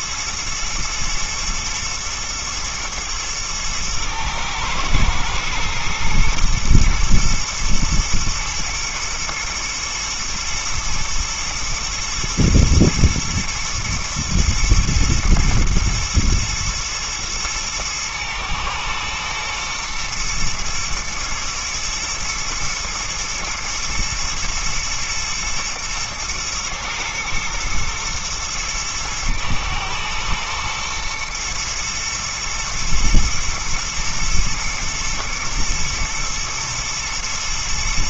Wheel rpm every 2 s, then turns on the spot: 110, 110, 120, 110, 120, 110, 120, 120, 110, 120, 120, 120, 110, 120, 110, 110, 110, 110, 110.
none